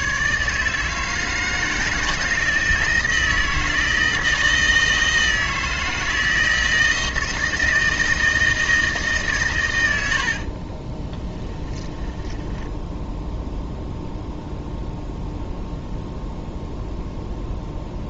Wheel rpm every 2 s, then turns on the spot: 160, 160, 160, 160, 160, 40, 10, 0, 0.
10-14